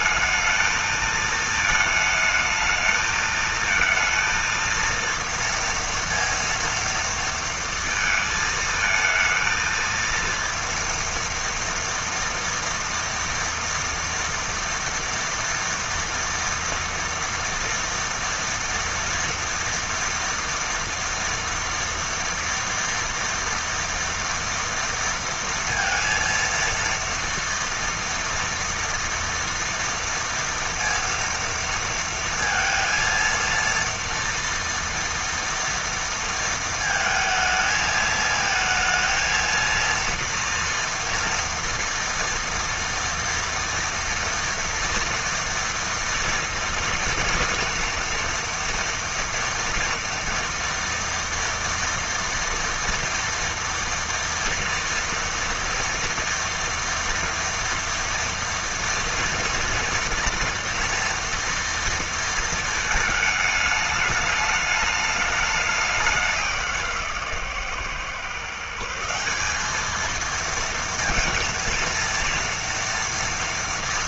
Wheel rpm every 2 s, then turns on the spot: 220, 220, 230, 230, 220, 230, 230, 240, 230, 230, 240, 230, 230, 230, 240, 230, 230, 230, 230, 220, 230, 230, 230, 230, 230, 230, 240, 240, 230, 230, 230, 220, 210, 170, 160, 220, 230.
none